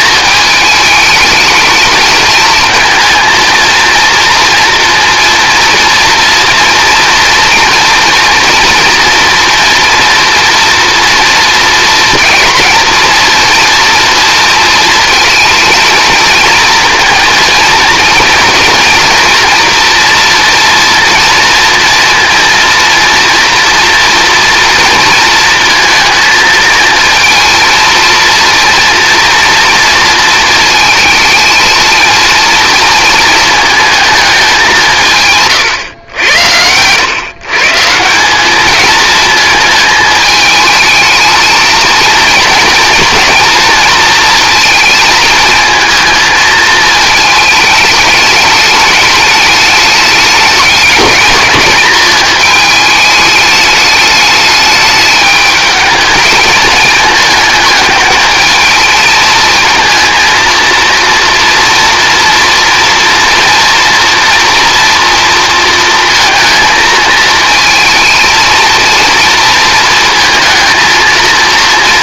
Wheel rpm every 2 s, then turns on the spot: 220, 220, 230, 230, 230, 240, 230, 220, 230, 230, 230, 230, 230, 230, 230, 220, 240, 210, 100, 190, 220, 230, 230, 220, 210, 210, 220, 210, 220, 220, 230, 230, 240, 230, 230, 230.
none